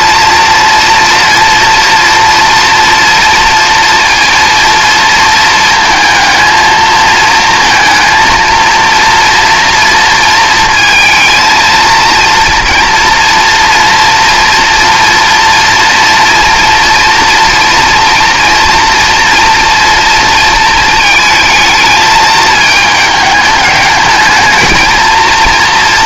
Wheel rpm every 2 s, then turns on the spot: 230, 240, 230, 230, 230, 230, 230, 230, 230, 230, 220, 210, 220.
none